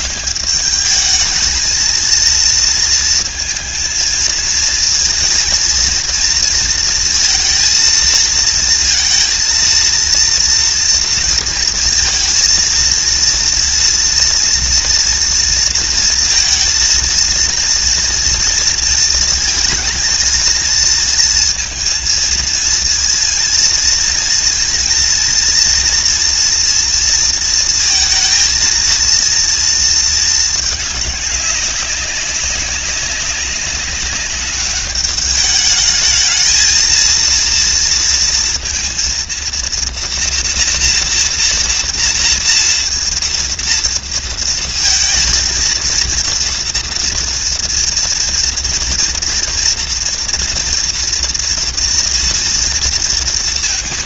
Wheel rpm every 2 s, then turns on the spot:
220, 220, 230, 230, 230, 230, 230, 240, 230, 230, 230, 230, 230, 230, 230, 200, 200, 210, 230, 230, 230, 230, 230, 240, 230, 230, 230.
none